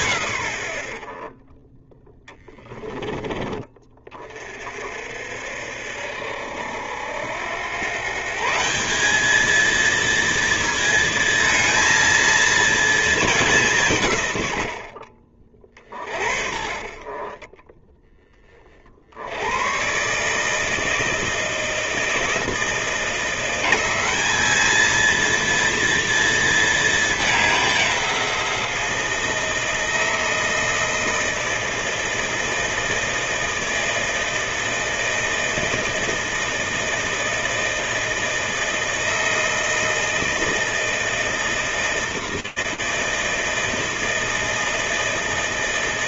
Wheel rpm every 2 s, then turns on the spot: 30, 20, 60, 100, 220, 230, 180, 30, 10, 100, 160, 180, 230, 200, 160, 160, 160, 160, 160, 160, 160, 160, 160.
none